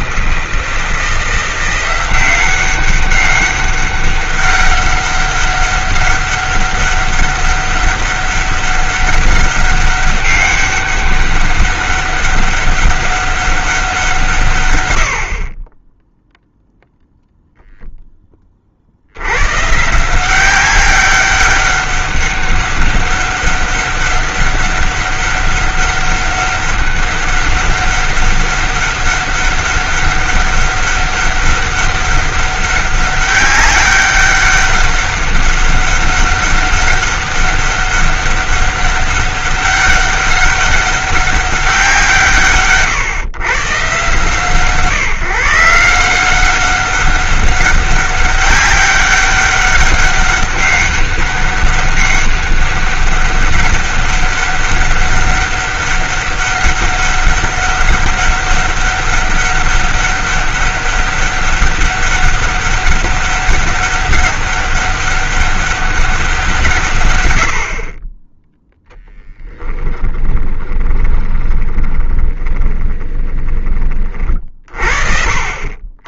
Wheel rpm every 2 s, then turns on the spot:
160, 190, 200, 200, 200, 200, 200, 120, 0, 40, 190, 200, 200, 200, 200, 200, 200, 200, 200, 200, 200, 140, 140, 190, 200, 200, 200, 200, 200, 200, 200, 200, 200, 160, 10, 20, 20, 50.
70-74